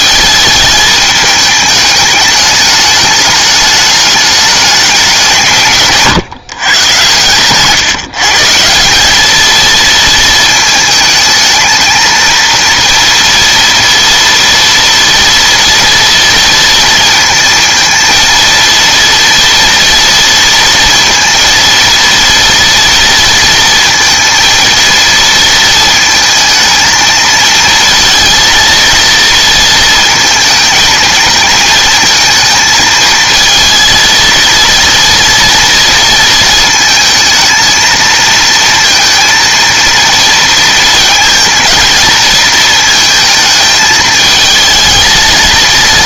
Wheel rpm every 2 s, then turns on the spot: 220, 210, 210, 130, 170, 220, 230, 230, 230, 230, 230, 230, 230, 220, 230, 220, 220, 230, 230, 230, 230, 230, 220.
none